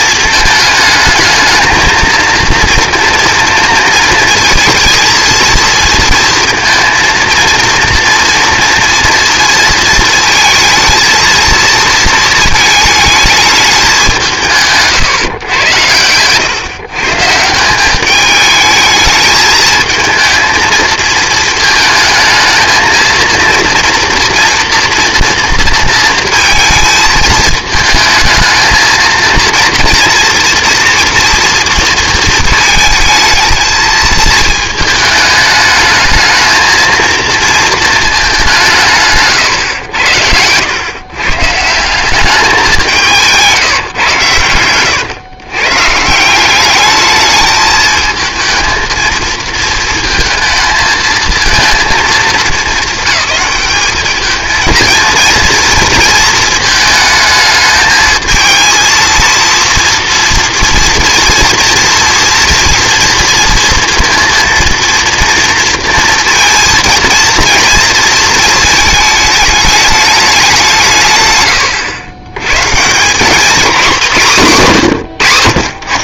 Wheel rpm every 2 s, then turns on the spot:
220, 230, 220, 230, 230, 220, 220, 170, 130, 210, 220, 220, 230, 220, 220, 230, 220, 220, 220, 190, 100, 190, 110, 200, 220, 230, 210, 220, 220, 220, 230, 230, 230, 230, 220, 180, 120, 150.
40-42 44-46